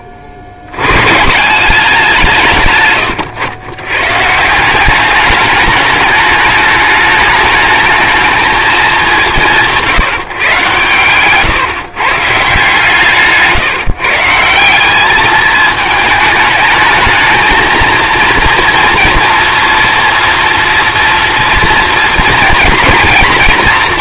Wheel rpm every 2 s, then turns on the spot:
60, 140, 170, 210, 210, 120, 160, 180, 220, 230, 240, 230.
none